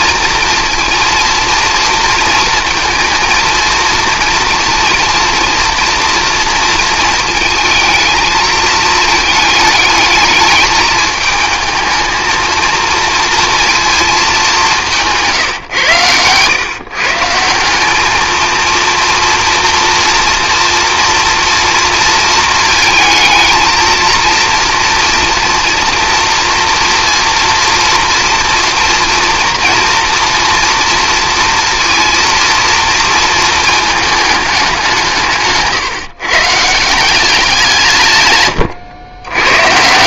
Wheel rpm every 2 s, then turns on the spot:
230, 230, 230, 220, 220, 210, 230, 170, 150, 230, 230, 230, 230, 230, 230, 230, 230, 180, 170, 110.
none